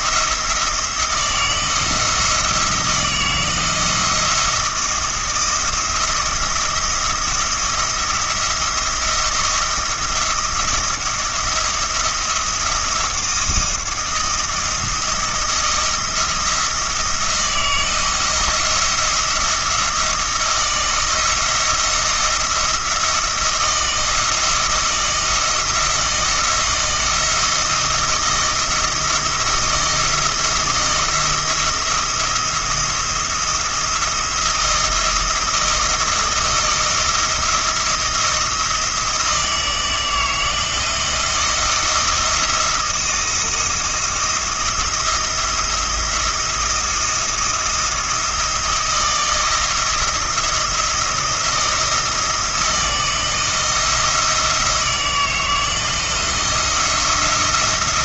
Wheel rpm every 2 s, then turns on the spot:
170, 170, 170, 170, 170, 170, 170, 160, 170, 170, 170, 170, 160, 160, 170, 170, 170, 170, 170, 160, 160, 170, 170, 170, 170, 170, 160, 160, 170.
none